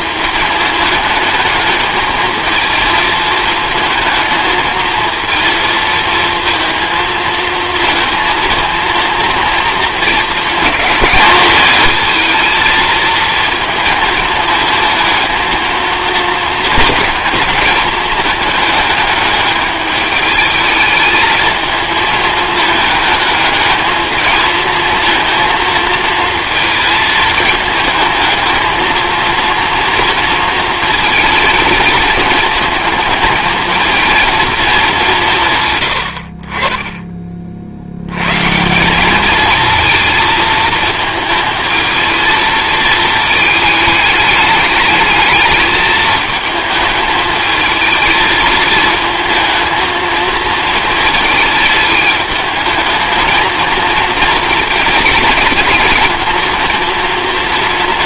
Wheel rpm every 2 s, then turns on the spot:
210, 220, 220, 230, 230, 210, 220, 220, 220, 210, 210, 220, 220, 220, 220, 230, 220, 210, 20, 180, 220, 220, 210, 220, 220, 230, 220, 220, 220.
none